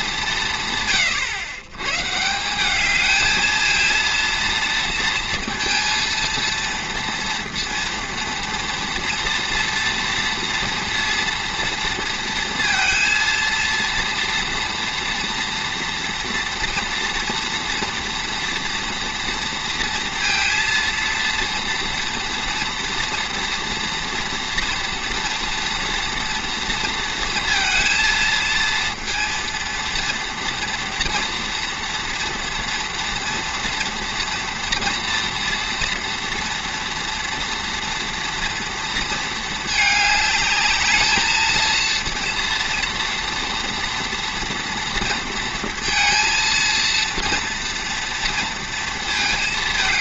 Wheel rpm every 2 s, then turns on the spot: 140, 190, 230, 230, 230, 230, 230, 230, 230, 240, 230, 230, 230, 230, 230, 230, 230, 230, 230, 230, 210, 230, 230, 230, 230.
none